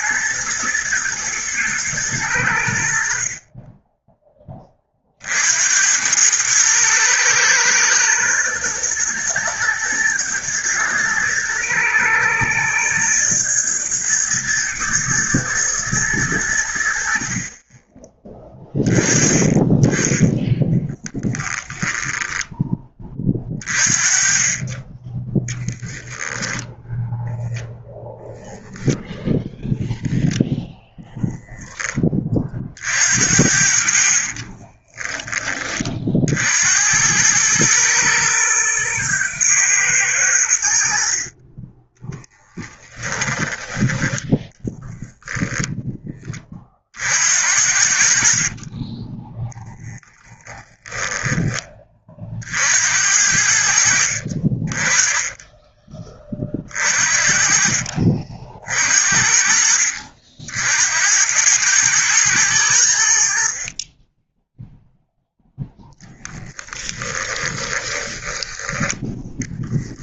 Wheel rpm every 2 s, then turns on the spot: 110, 60, 40, 110, 120, 110, 110, 120, 70, 20, 10, 20, 20, 0, 0, 0, 50, 20, 90, 110, 60, 10, 0, 50, 20, 10, 60, 30, 50, 50, 80, 80, 0, 10, 10.
20-22 34-36 42-44 48-50 66-68